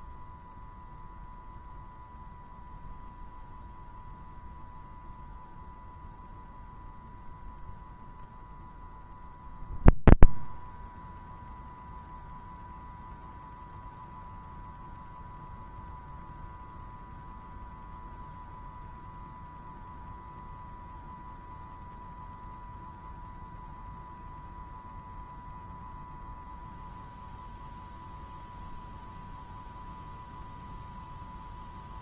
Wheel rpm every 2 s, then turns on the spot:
120, 120, 120, 120, 120, 120, 120, 120, 120, 120, 120, 120, 120, 120, 120, 120.
none